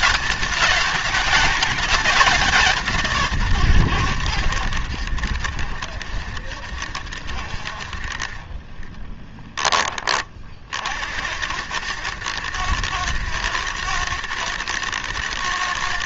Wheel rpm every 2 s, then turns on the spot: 210, 190, 100, 70, 30, 40, 110, 110.
8-10